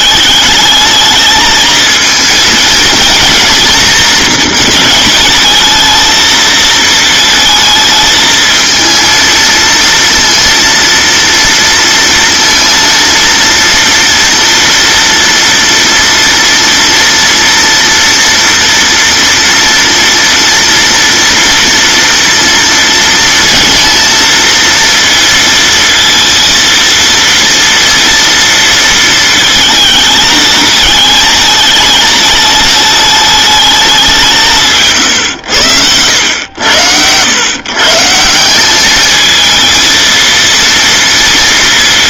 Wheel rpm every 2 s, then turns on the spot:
210, 240, 220, 220, 230, 230, 230, 230, 230, 230, 230, 230, 230, 230, 230, 210, 220, 160, 90, 200, 230.
none